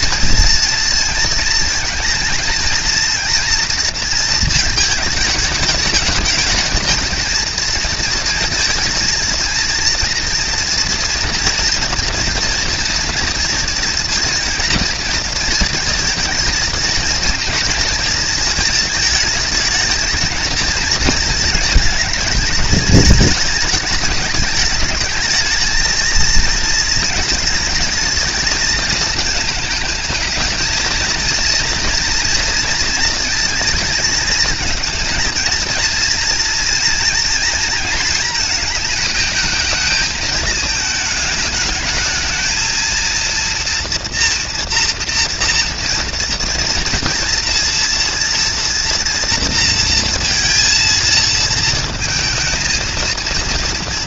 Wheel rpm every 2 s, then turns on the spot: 230, 230, 220, 210, 230, 230, 230, 230, 230, 220, 230, 220, 210, 230, 220, 220, 230, 230, 230, 220, 220, 220, 230, 230, 230, 230, 220.
none